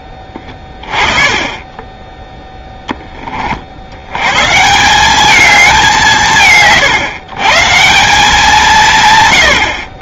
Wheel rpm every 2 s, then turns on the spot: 10, 10, 180, 110, 150.
none